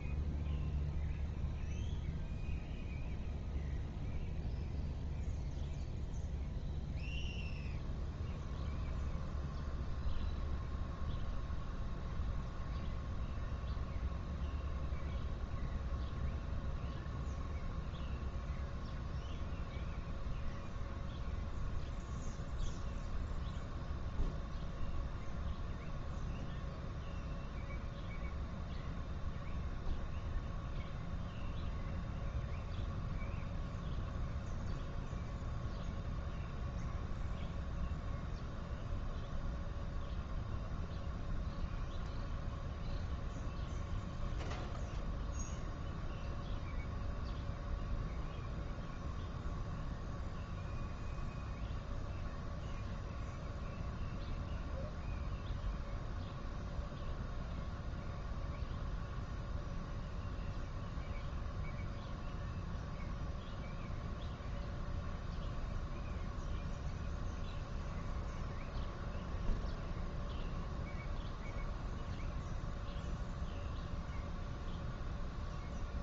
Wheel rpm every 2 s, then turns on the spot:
0, 0, 0, 0, 0, 0, 0, 0, 0, 0, 0, 0, 0, 0, 0, 0, 0, 0, 0, 0, 0, 0, 0, 0, 0, 0, 0, 0, 0, 0, 0, 0, 0, 0, 0, 0, 0, 0.
none